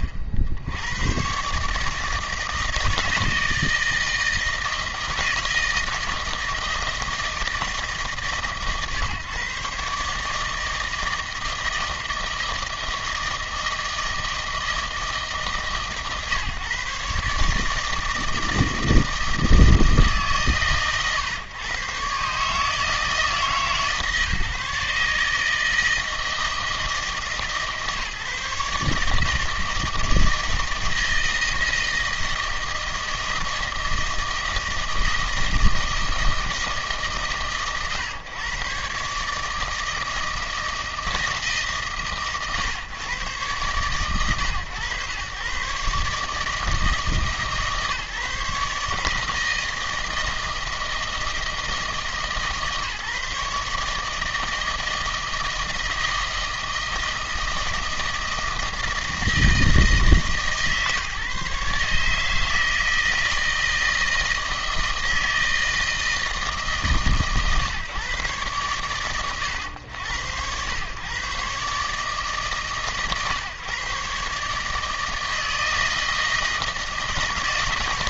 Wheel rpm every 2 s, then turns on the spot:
80, 160, 160, 160, 130, 160, 160, 160, 140, 160, 120, 150, 150, 160, 150, 160, 160, 160, 160, 130, 160, 120, 110, 160, 150, 160, 150, 160, 160, 160, 150, 160, 160, 150, 120, 100, 140, 150, 160.
none